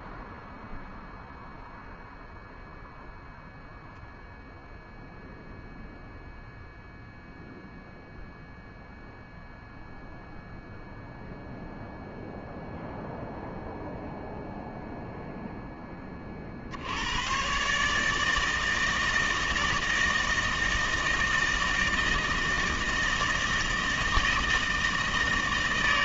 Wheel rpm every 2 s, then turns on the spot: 0, 0, 0, 0, 0, 0, 0, 20, 150, 160, 160, 160, 160.
none